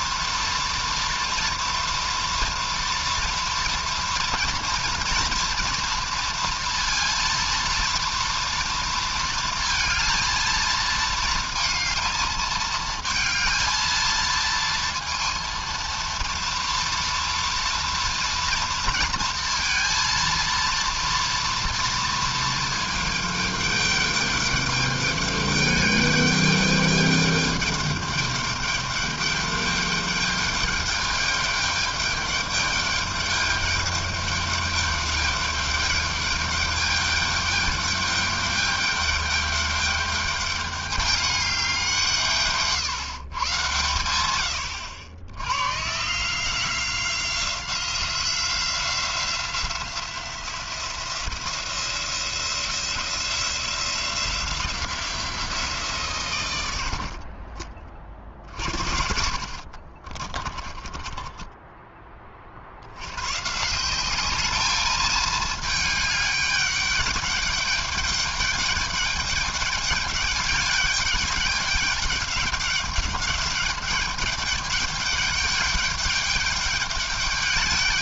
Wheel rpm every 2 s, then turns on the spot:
230, 230, 230, 230, 230, 230, 220, 230, 230, 230, 230, 220, 210, 210, 210, 210, 210, 210, 210, 210, 210, 160, 100, 160, 180, 180, 170, 180, 110, 50, 20, 40, 210, 200, 210, 210, 210, 210, 210.
60-62